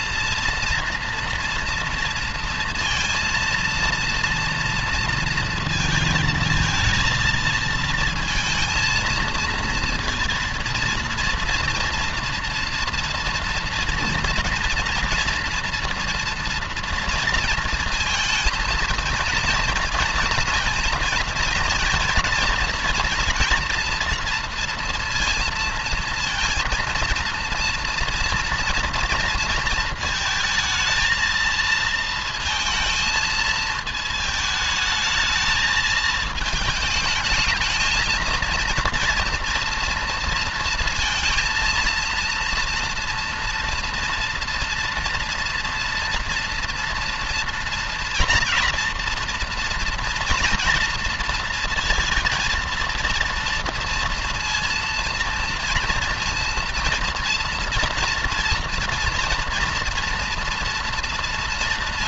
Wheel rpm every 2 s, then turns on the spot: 230, 230, 230, 230, 230, 230, 230, 230, 230, 230, 230, 230, 230, 230, 230, 220, 220, 220, 210, 230, 230, 230, 230, 230, 240, 230, 230, 230, 230, 230, 230.
none